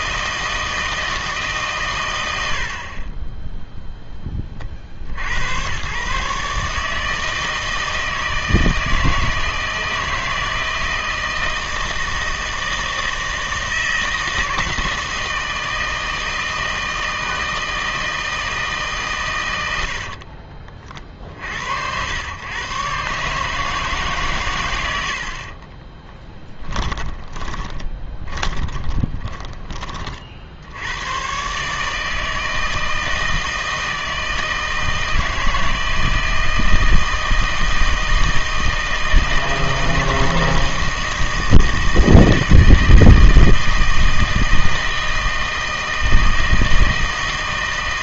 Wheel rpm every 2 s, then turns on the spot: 160, 50, 50, 150, 160, 160, 160, 160, 160, 150, 40, 130, 100, 20, 20, 90, 160, 160, 160, 160, 160, 160, 160, 160.
2-4 26-30